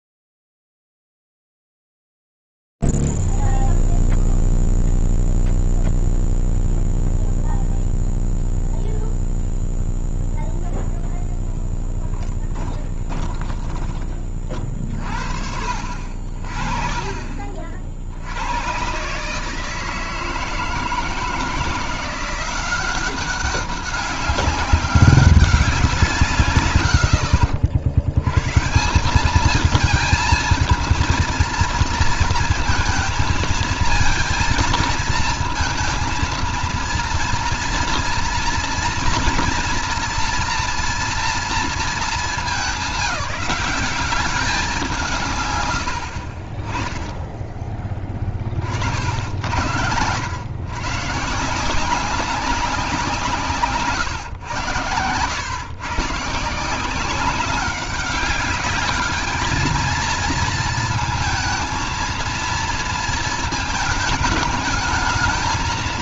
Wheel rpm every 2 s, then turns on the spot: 0, 0, 0, 0, 0, 0, 10, 30, 40, 80, 160, 180, 200, 130, 140, 230, 230, 220, 230, 230, 230, 190, 180, 30, 50, 120, 180, 110, 170, 210, 230, 230, 220.
12-14